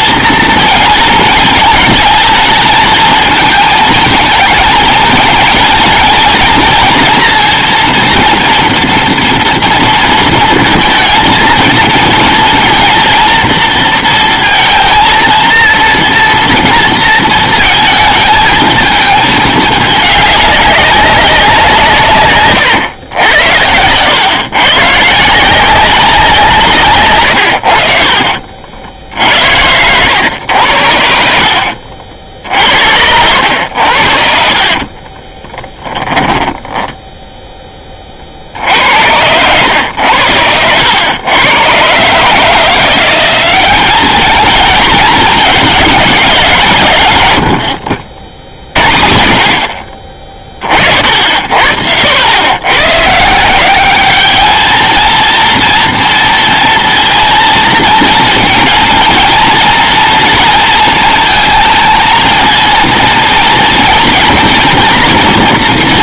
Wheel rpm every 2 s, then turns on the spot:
240, 220, 220, 230, 230, 230, 220, 230, 240, 220, 200, 130, 130, 170, 60, 90, 60, 60, 10, 70, 100, 150, 210, 180, 60, 30, 90, 210, 230, 230, 230, 230, 230.
34-36